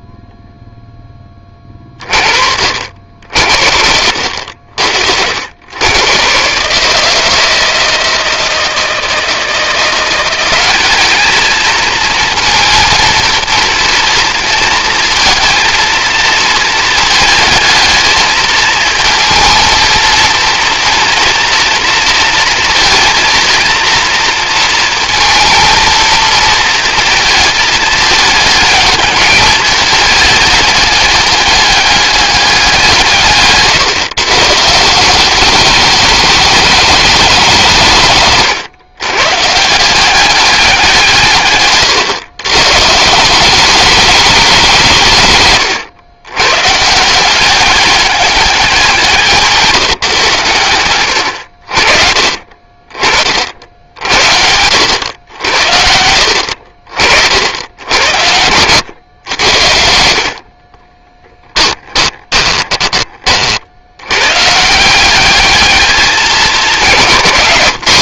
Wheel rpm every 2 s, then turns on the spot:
0, 50, 70, 150, 160, 200, 230, 230, 230, 220, 230, 230, 230, 220, 210, 210, 190, 160, 200, 130, 180, 140, 190, 140, 190, 110, 40, 90, 60, 100, 40, 20, 170, 180.
60-62